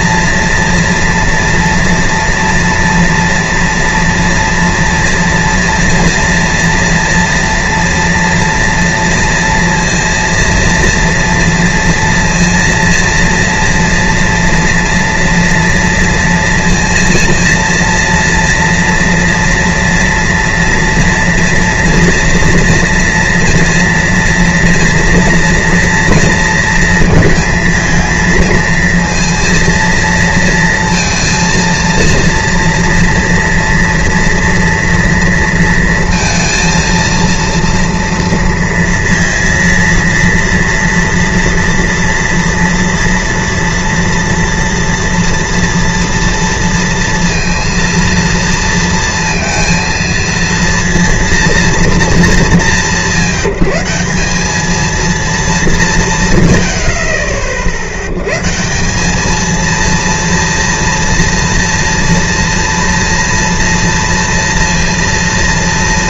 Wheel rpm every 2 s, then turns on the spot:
230, 230, 240, 230, 230, 230, 230, 230, 230, 240, 230, 230, 240, 230, 230, 230, 230, 230, 230, 230, 230, 230, 230, 230, 230, 230, 190, 220, 80, 160, 230, 230, 230.
none